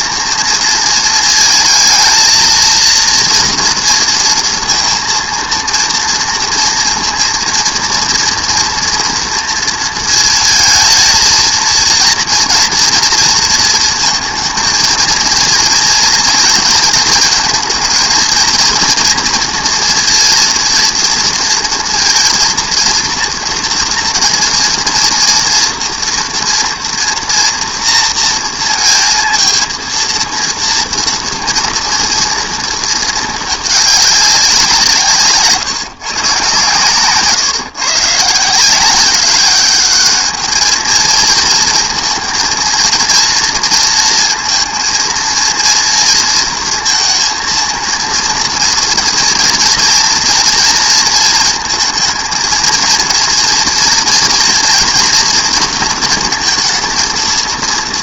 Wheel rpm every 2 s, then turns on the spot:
230, 230, 230, 230, 230, 220, 230, 230, 230, 230, 230, 230, 230, 240, 230, 230, 220, 170, 130, 170, 220, 230, 230, 230, 230, 230, 230, 230, 220.
none